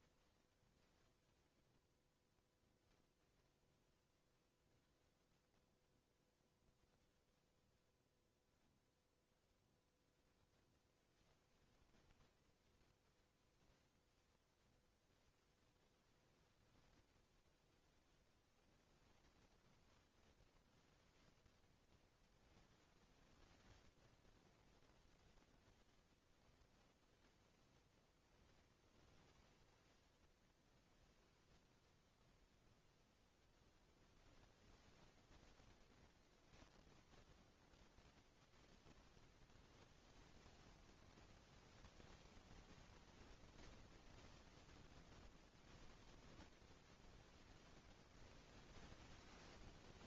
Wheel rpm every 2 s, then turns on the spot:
0, 0, 0, 0, 0, 0, 0, 0, 0, 0, 0, 0, 0, 0, 0, 0, 0, 0, 0, 0, 0, 0, 0, 0, 0.
none